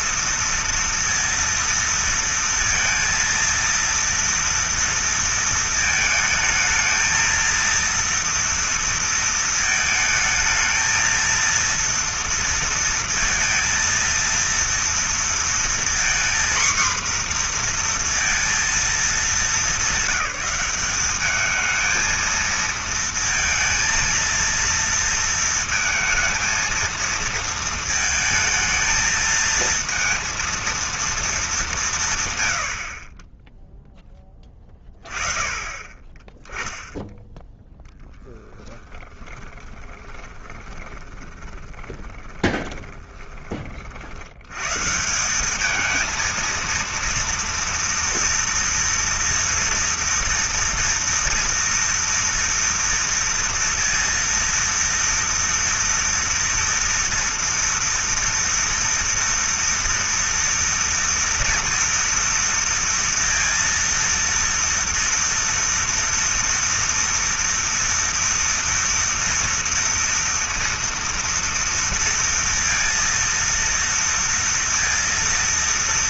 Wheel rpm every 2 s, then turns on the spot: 230, 230, 230, 220, 230, 220, 230, 230, 240, 230, 190, 230, 230, 230, 220, 230, 100, 20, 10, 20, 20, 20, 100, 230, 240, 230, 230, 230, 230, 240, 230, 230, 230, 230, 230, 230, 230, 230.
38-44